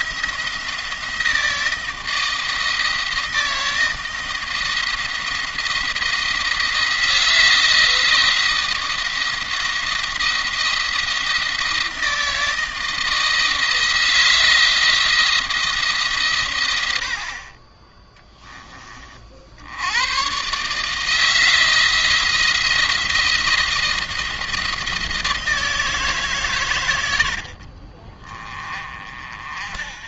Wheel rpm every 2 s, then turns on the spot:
170, 160, 170, 170, 170, 170, 160, 170, 90, 30, 150, 170, 170, 130, 40.
none